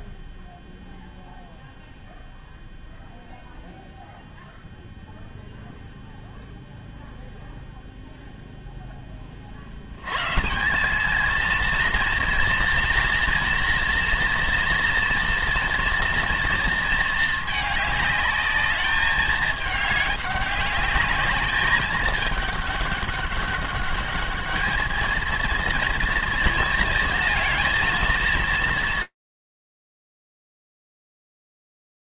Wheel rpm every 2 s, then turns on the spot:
0, 0, 0, 0, 20, 220, 230, 230, 220, 210, 210, 200, 220, 230, 160, 0.
none